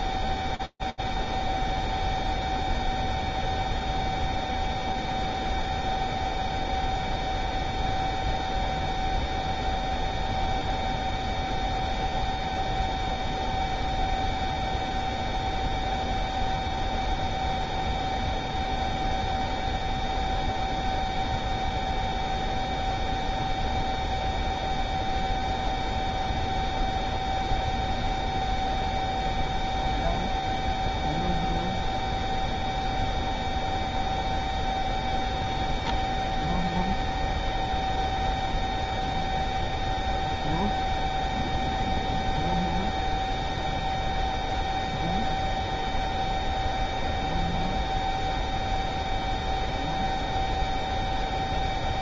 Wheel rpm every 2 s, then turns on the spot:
0, 0, 0, 0, 0, 0, 0, 0, 0, 0, 0, 0, 0, 0, 0, 0, 0, 0, 0, 0, 0, 0, 0, 0, 0, 0.
none